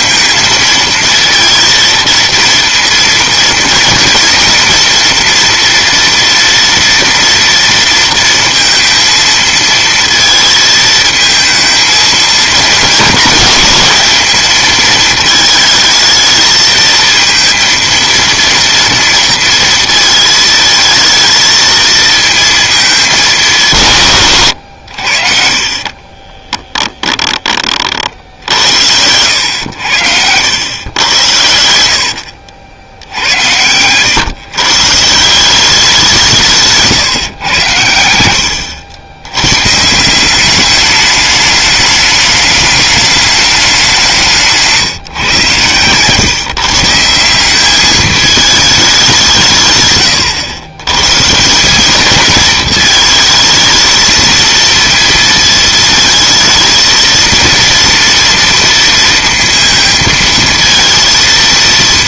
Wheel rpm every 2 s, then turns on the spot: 230, 230, 230, 230, 230, 220, 230, 220, 220, 230, 220, 220, 110, 10, 70, 90, 80, 140, 160, 90, 200, 210, 160, 150, 210, 110, 220, 230, 230, 230, 230.
24-28 36-38 44-46